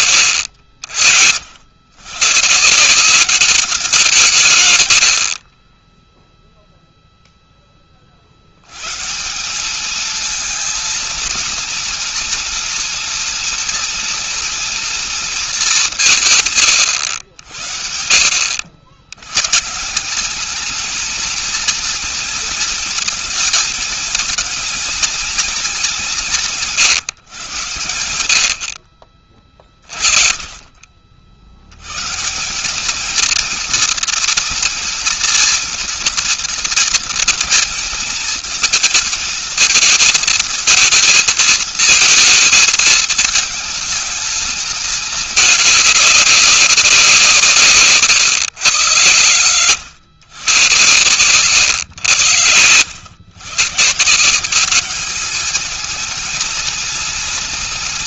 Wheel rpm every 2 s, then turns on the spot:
80, 160, 110, 0, 140, 230, 240, 230, 110, 90, 220, 220, 230, 130, 50, 40, 220, 240, 230, 220, 230, 220, 220, 180, 120, 120, 110, 200, 230.
none